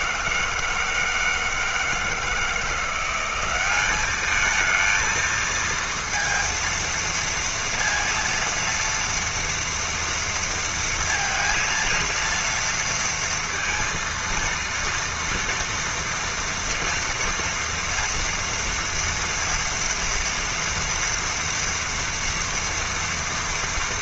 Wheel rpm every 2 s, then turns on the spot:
160, 180, 230, 230, 230, 230, 230, 230, 230, 230, 230, 230.
none